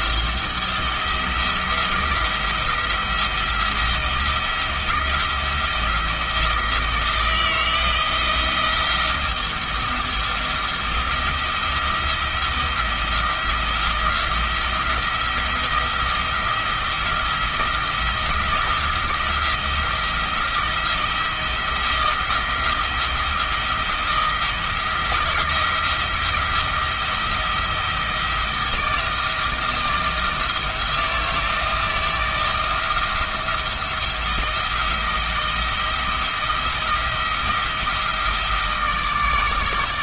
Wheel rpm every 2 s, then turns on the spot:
170, 170, 170, 160, 170, 170, 170, 170, 170, 170, 170, 170, 170, 170, 160, 160, 170, 170, 170, 160.
none